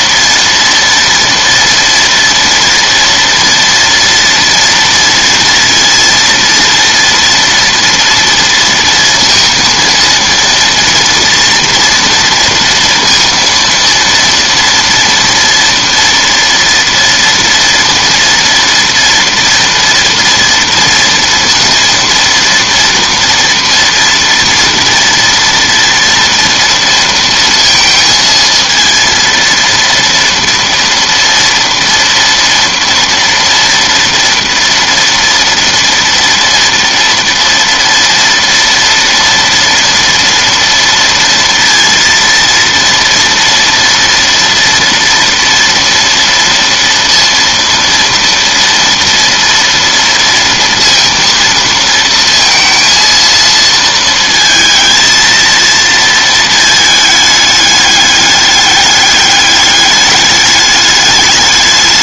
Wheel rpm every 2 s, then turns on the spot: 230, 230, 230, 230, 230, 230, 230, 230, 240, 230, 230, 240, 240, 230, 230, 230, 230, 240, 230, 230, 230, 230, 230, 230, 230, 230, 230, 230, 220, 210, 210.
none